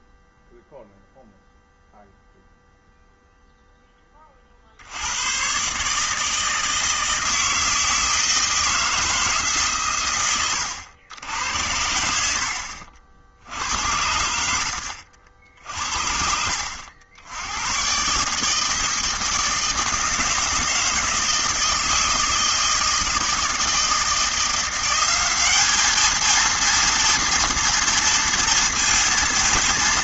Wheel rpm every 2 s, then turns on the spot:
0, 0, 50, 160, 160, 100, 80, 90, 70, 150, 160, 160, 170, 230, 230.
none